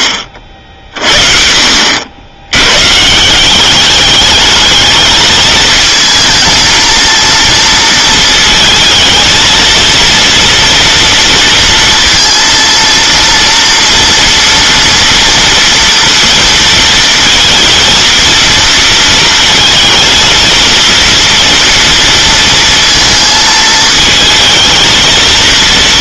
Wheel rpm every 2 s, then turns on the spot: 60, 120, 210, 230, 220, 230, 230, 230, 230, 230, 230, 230, 220.
none